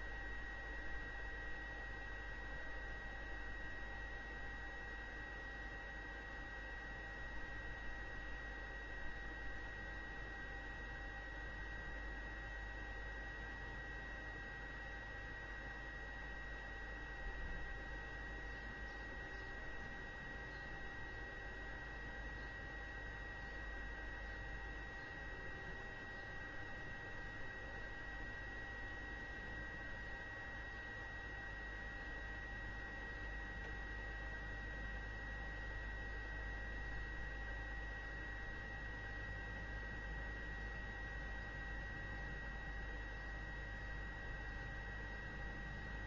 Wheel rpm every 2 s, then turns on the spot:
0, 0, 0, 0, 0, 0, 0, 0, 0, 0, 0, 0, 0, 0, 0, 0, 0, 0, 0, 0, 0, 0, 0.
none